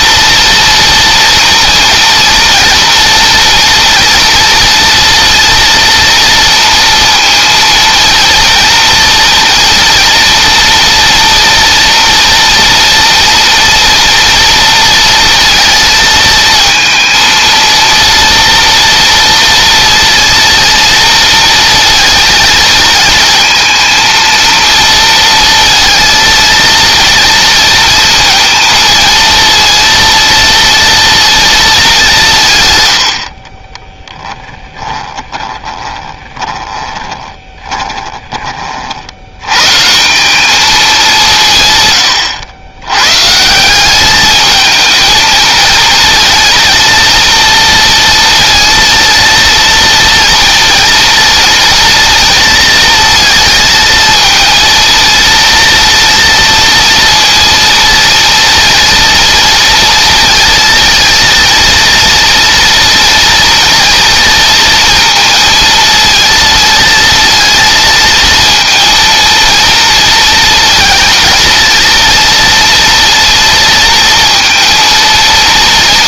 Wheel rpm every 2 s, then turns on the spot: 230, 240, 230, 230, 230, 230, 230, 230, 230, 230, 230, 220, 230, 230, 230, 230, 100, 20, 20, 60, 210, 130, 220, 230, 230, 230, 230, 230, 230, 230, 230, 230, 230, 230, 230, 220, 230, 230.
34-38